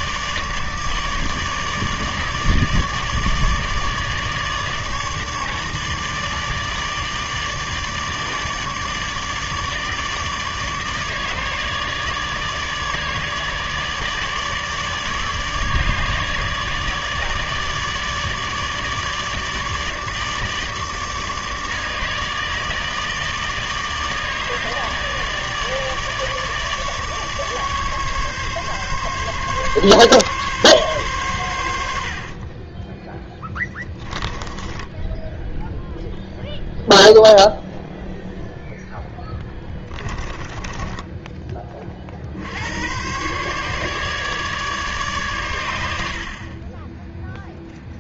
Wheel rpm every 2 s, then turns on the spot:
150, 150, 150, 150, 150, 150, 150, 150, 150, 150, 150, 150, 150, 150, 140, 140, 40, 10, 0, 10, 20, 70, 150, 40.
32-36 40-42